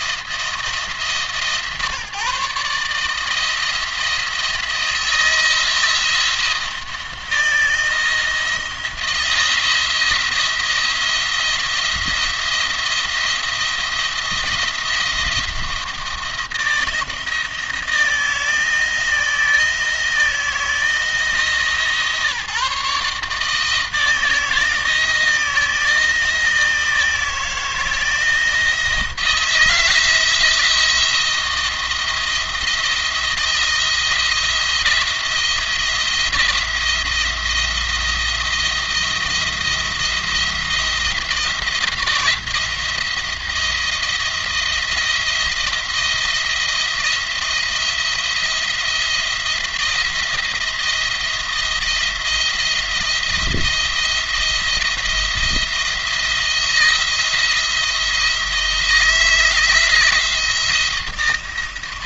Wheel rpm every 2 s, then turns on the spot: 160, 150, 170, 170, 160, 160, 170, 170, 170, 160, 170, 150, 160, 160, 170, 170, 170, 170, 170, 170, 170, 170, 170, 170, 170, 170, 170, 170, 170, 160, 170.
none